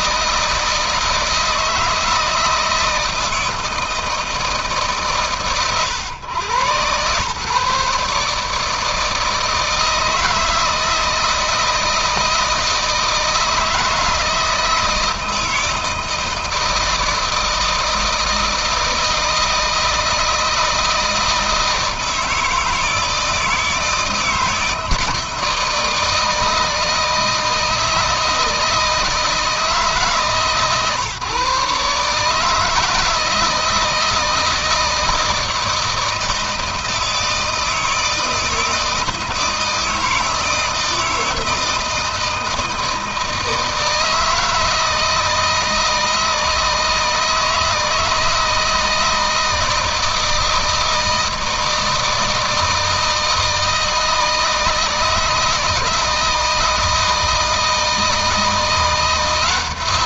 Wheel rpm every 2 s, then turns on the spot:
160, 160, 150, 120, 160, 160, 160, 160, 160, 160, 160, 160, 160, 160, 160, 140, 150, 160, 160, 160, 160, 160, 160, 160, 160, 160, 160, 160, 160, 170.
none